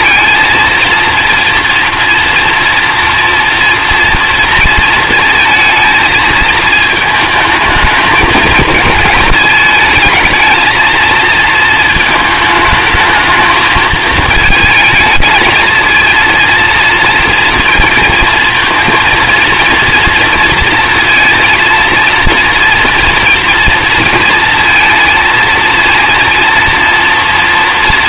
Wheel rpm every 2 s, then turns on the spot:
230, 230, 230, 220, 230, 230, 220, 220, 230, 230, 230, 230, 230, 230.
none